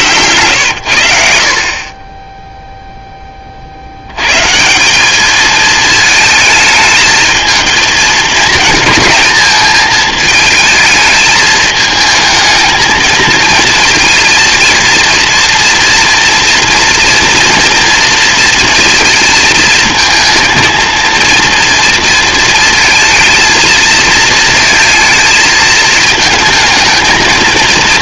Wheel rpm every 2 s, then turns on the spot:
80, 10, 200, 220, 220, 210, 220, 230, 240, 230, 230, 230, 220, 220.
none